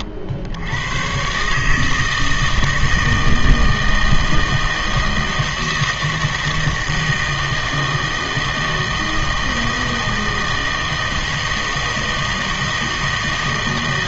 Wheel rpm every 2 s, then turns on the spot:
90, 160, 160, 160, 160, 160, 160.
none